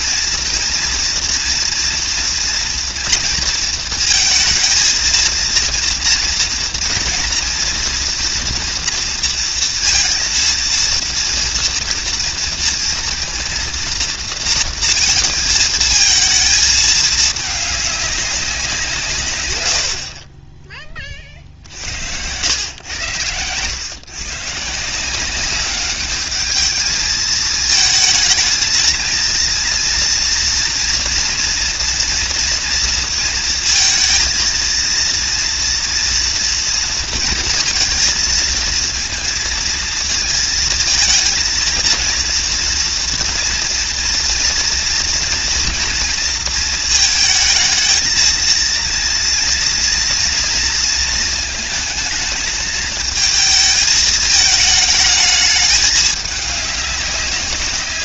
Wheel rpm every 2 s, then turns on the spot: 230, 230, 230, 230, 230, 230, 230, 230, 220, 150, 30, 100, 170, 220, 230, 240, 230, 230, 230, 230, 220, 230, 230, 220, 230, 230, 220, 220, 200.
none